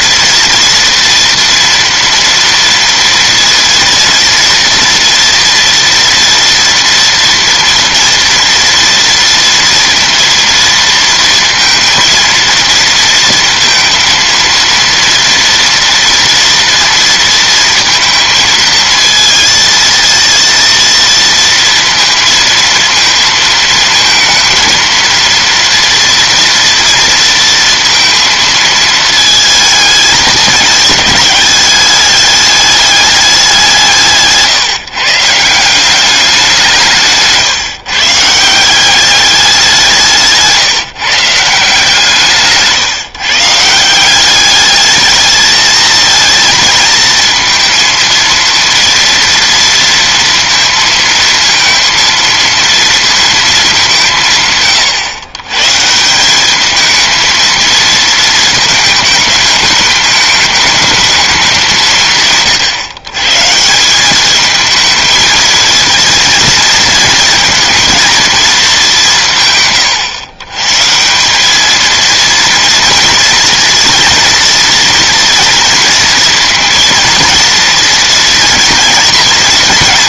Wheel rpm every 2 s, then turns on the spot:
240, 230, 230, 230, 230, 230, 230, 230, 230, 230, 230, 230, 230, 230, 220, 210, 200, 150, 180, 170, 160, 150, 210, 220, 230, 230, 230, 130, 210, 220, 210, 140, 220, 230, 210, 140, 230, 230, 230, 230.
none